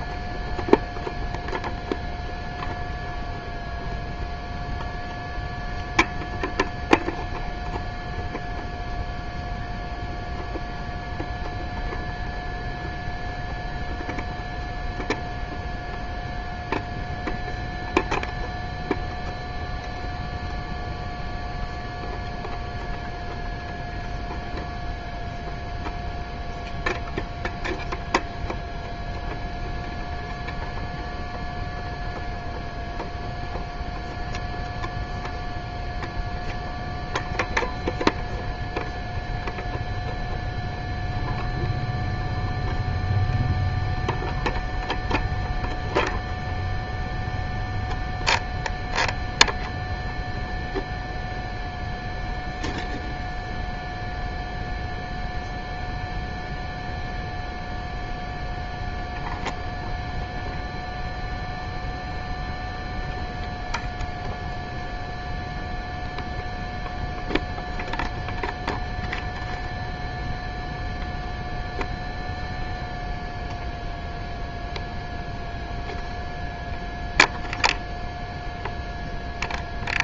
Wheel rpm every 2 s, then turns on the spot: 0, 0, 0, 0, 0, 0, 0, 0, 0, 0, 0, 0, 0, 0, 0, 0, 0, 0, 0, 0, 0, 0, 0, 0, 0, 0, 0, 0, 0, 0, 0, 0, 0, 0, 0, 0, 0, 0, 0, 0.
none